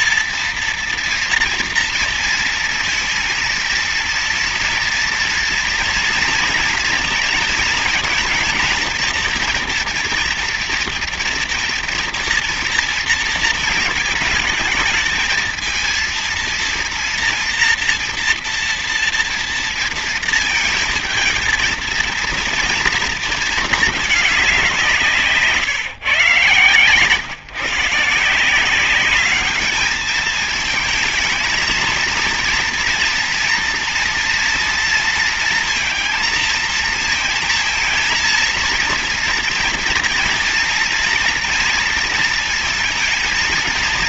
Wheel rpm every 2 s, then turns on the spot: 230, 230, 230, 230, 230, 230, 230, 220, 230, 230, 220, 230, 190, 140, 180, 220, 230, 230, 230, 230, 230, 230.
none